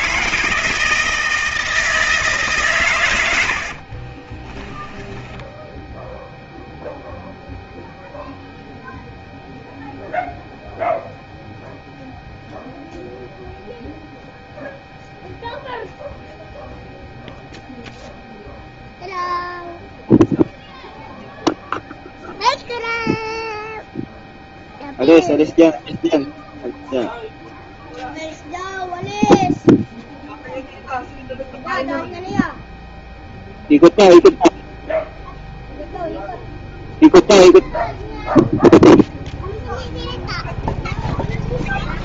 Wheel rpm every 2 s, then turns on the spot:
160, 130, 10, 0, 0, 0, 0, 0, 0, 0, 0, 0, 0, 0, 0, 0, 0, 0, 0, 0, 0.
4-6